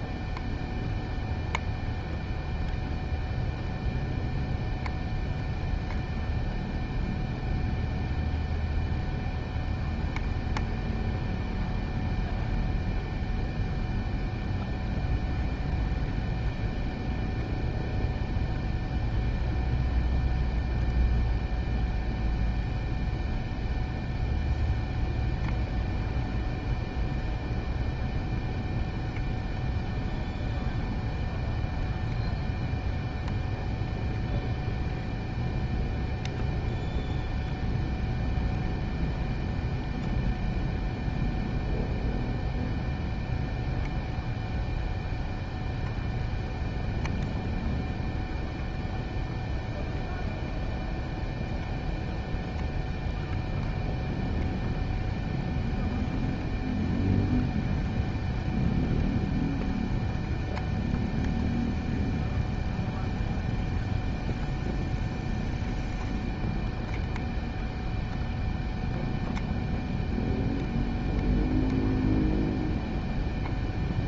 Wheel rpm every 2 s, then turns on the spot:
0, 0, 0, 0, 0, 0, 0, 0, 0, 0, 0, 0, 0, 0, 0, 0, 0, 0, 0, 0, 0, 0, 0, 0, 0, 0, 0, 0, 0, 0, 0, 0, 0, 0, 0, 0, 0.
none